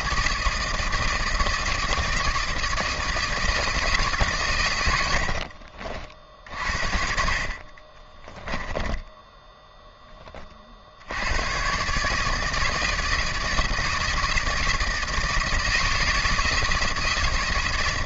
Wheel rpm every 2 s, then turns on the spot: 160, 160, 110, 60, 10, 50, 160, 160, 160.
8-10